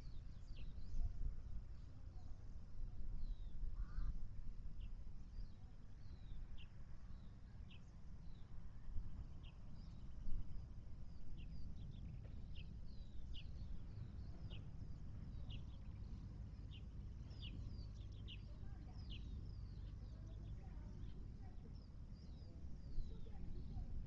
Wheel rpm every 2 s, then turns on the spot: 0, 0, 0, 0, 0, 0, 0, 0, 0, 0, 0, 0.
none